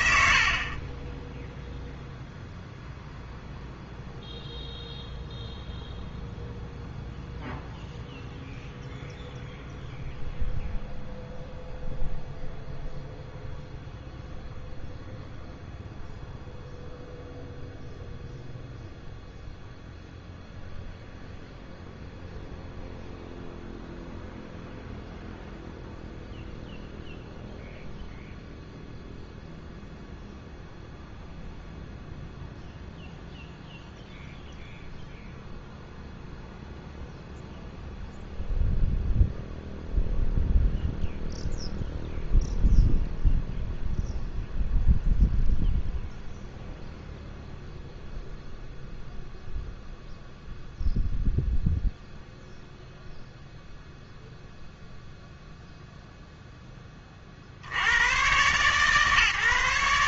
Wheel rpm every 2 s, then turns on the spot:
60, 0, 0, 0, 0, 0, 0, 0, 0, 0, 0, 0, 0, 0, 0, 0, 0, 0, 0, 0, 0, 0, 0, 0, 0, 0, 0, 0, 10, 140.
none